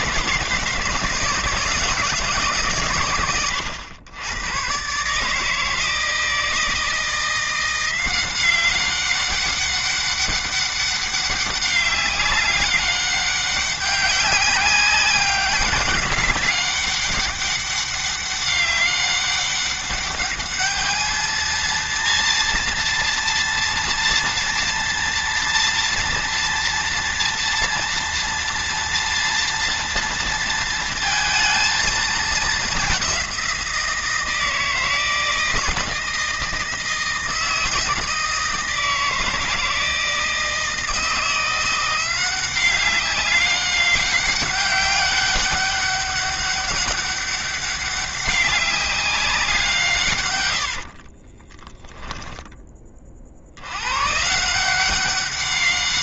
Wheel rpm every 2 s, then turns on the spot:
160, 140, 130, 160, 190, 200, 200, 190, 200, 200, 210, 230, 230, 230, 230, 230, 200, 160, 170, 160, 160, 190, 190, 200, 190, 60, 30, 180.
50-52